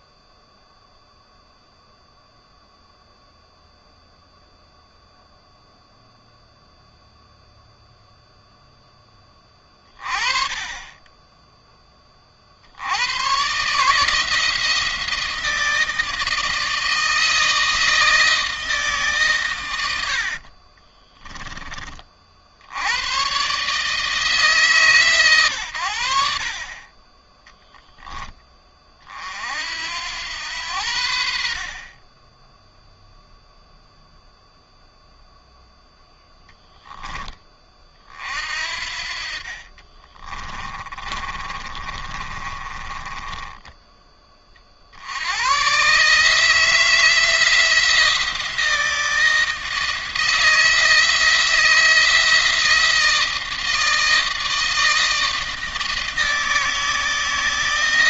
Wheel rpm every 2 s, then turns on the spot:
0, 0, 0, 0, 10, 10, 100, 170, 160, 150, 30, 100, 140, 30, 40, 80, 0, 0, 10, 50, 20, 20, 70, 160, 160, 160, 160, 160, 160.
20-22 38-44